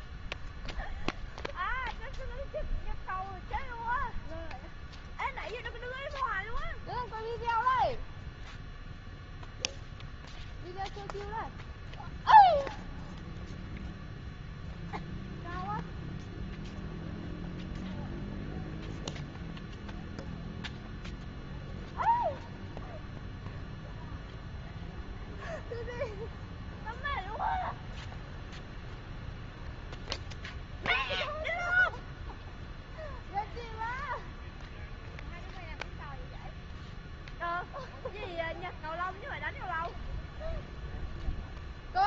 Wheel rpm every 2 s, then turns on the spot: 0, 0, 0, 0, 0, 0, 0, 0, 0, 0, 0, 0, 0, 0, 0, 0, 0, 0, 0, 0, 0.
none